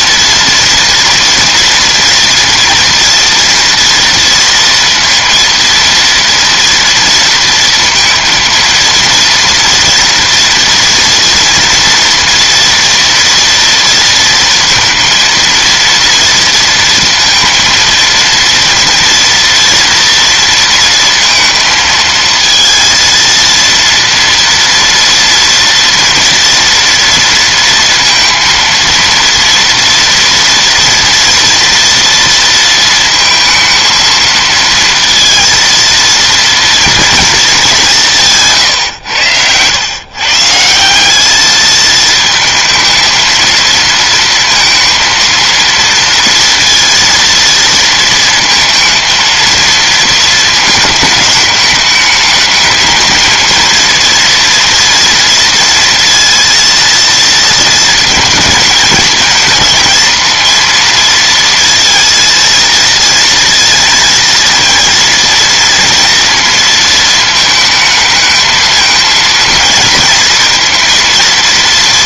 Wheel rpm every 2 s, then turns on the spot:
230, 230, 230, 230, 230, 230, 230, 230, 230, 230, 230, 230, 230, 230, 230, 230, 230, 230, 230, 130, 170, 220, 230, 230, 230, 220, 210, 230, 230, 220, 230, 230, 230, 230, 220, 230.
none